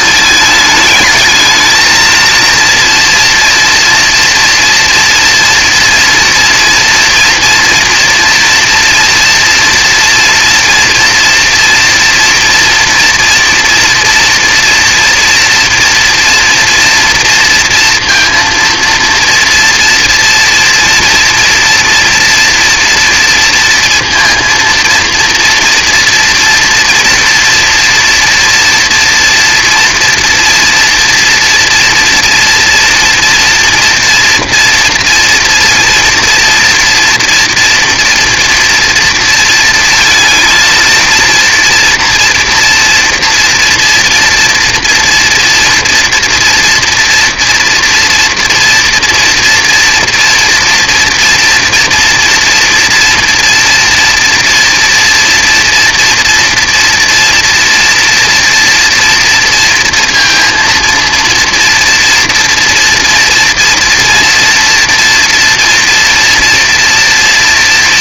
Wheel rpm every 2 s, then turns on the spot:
220, 230, 230, 230, 230, 240, 230, 240, 230, 230, 230, 230, 230, 240, 230, 230, 240, 230, 230, 230, 230, 230, 230, 230, 230, 240, 230, 230, 230, 230, 230, 230, 230, 230.
none